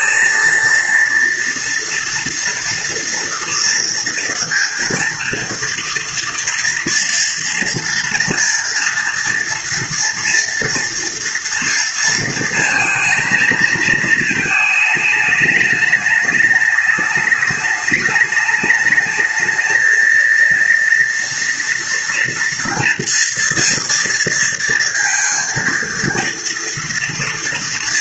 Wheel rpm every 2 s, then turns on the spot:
230, 230, 230, 230, 240, 230, 230, 220, 210, 210, 230, 230, 230, 230.
none